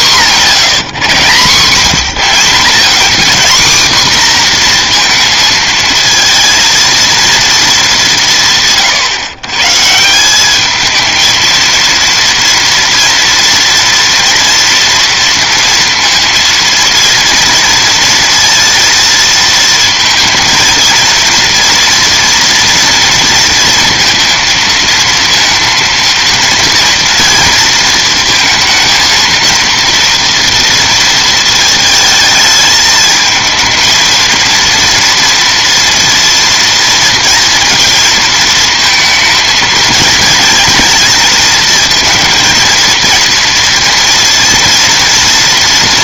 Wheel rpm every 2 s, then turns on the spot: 190, 140, 250, 230, 150, 190, 230, 230, 230, 230, 230, 230, 230, 230, 230, 230, 220, 230, 230, 220, 220, 230, 230.
none